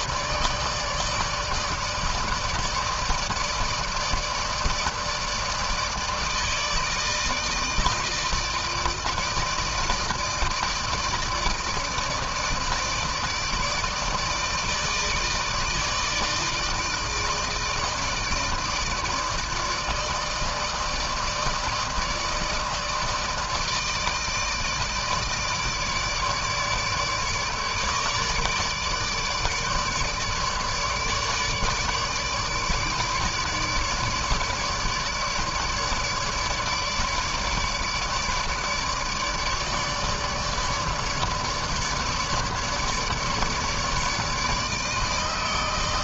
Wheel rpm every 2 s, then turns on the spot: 150, 160, 160, 160, 160, 160, 160, 160, 160, 150, 150, 160, 150, 150, 150, 150, 160, 150, 150, 150, 150, 150, 160.
none